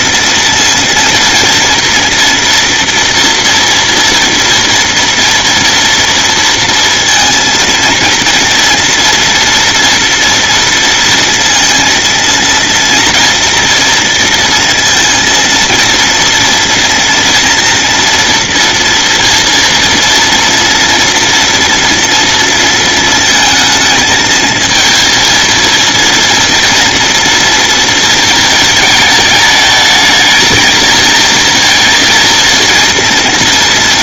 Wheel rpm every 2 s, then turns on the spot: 230, 230, 230, 230, 230, 230, 230, 230, 230, 230, 230, 230, 220, 240, 220, 220, 230.
none